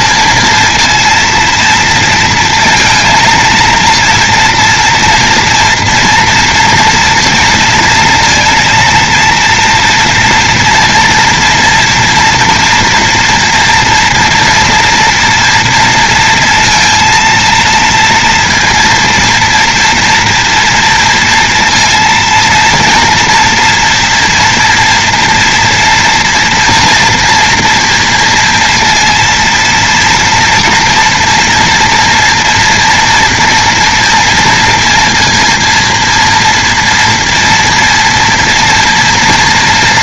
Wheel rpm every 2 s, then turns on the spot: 230, 230, 230, 230, 230, 230, 230, 230, 230, 230, 230, 240, 230, 230, 230, 240, 230, 230, 230, 240.
none